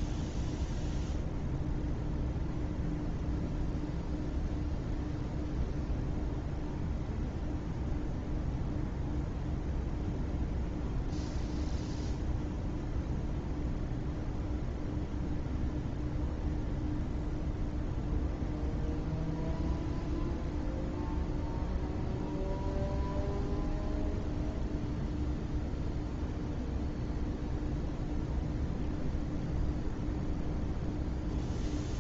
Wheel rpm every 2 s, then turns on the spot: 0, 0, 0, 0, 0, 0, 0, 0, 0, 0, 0, 0, 0, 0, 0, 0.
none